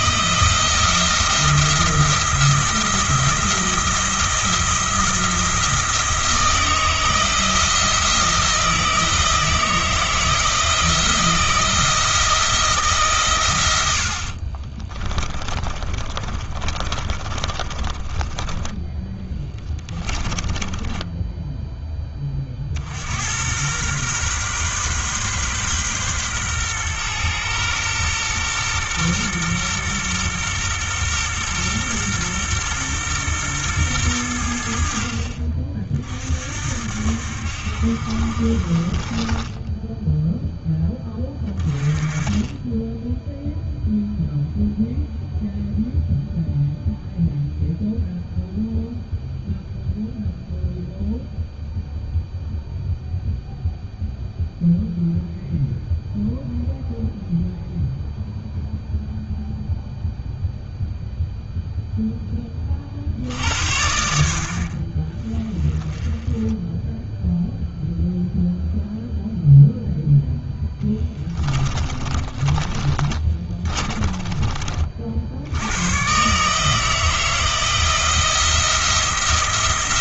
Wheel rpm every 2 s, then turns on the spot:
170, 170, 170, 160, 170, 170, 160, 30, 30, 10, 10, 50, 130, 120, 120, 120, 120, 70, 60, 50, 10, 10, 0, 0, 0, 0, 0, 0, 0, 0, 0, 30, 50, 10, 0, 10, 30, 40, 160, 170.
14-18 20-22 70-74